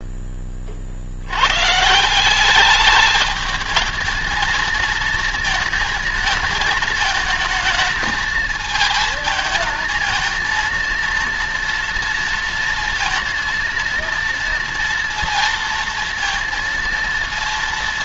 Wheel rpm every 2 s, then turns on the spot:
70, 210, 230, 220, 220, 230, 230, 230, 230.
none